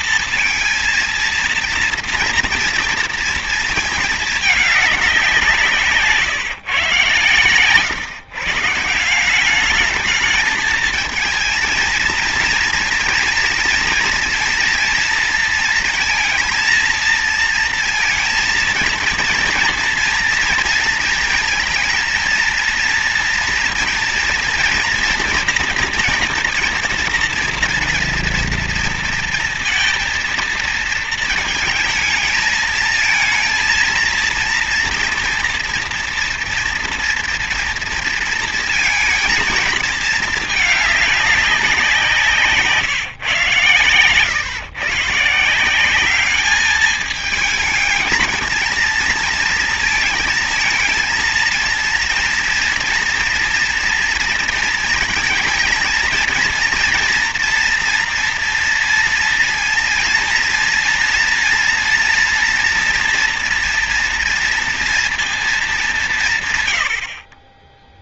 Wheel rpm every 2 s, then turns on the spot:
230, 230, 210, 140, 150, 210, 230, 230, 230, 230, 230, 230, 230, 240, 230, 230, 220, 230, 240, 230, 220, 170, 130, 210, 220, 230, 230, 230, 230, 230, 230, 240, 230, 150.
none